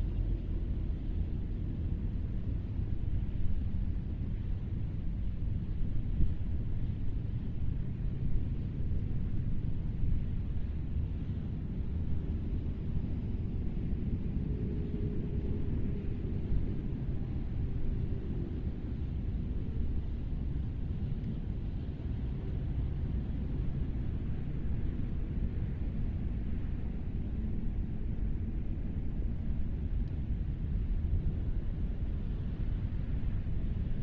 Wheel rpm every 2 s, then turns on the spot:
0, 0, 0, 0, 0, 0, 0, 0, 0, 0, 0, 0, 0, 0, 0, 0, 0.
none